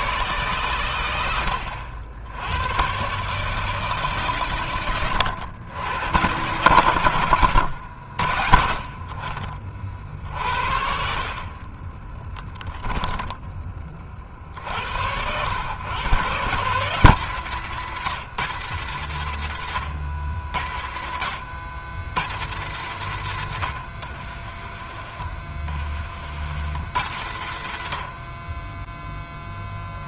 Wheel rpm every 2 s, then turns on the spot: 120, 110, 100, 100, 50, 60, 10, 60, 160, 170, 120, 150, 50, 100, 20.
12-14 24-26